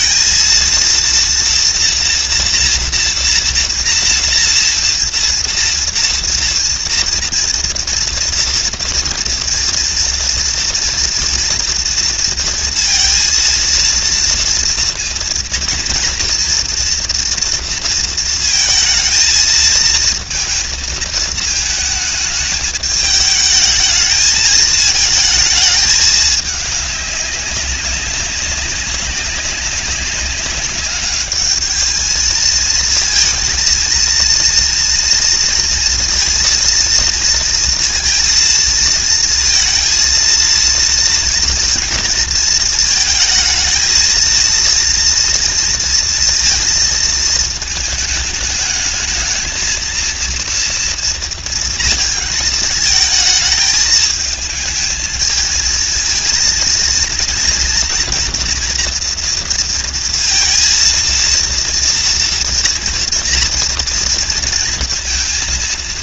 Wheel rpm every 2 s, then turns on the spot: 230, 230, 230, 230, 230, 230, 230, 230, 230, 230, 220, 220, 220, 200, 200, 210, 220, 230, 230, 230, 230, 220, 230, 230, 220, 230, 220, 220, 230, 230, 230, 230, 230.
none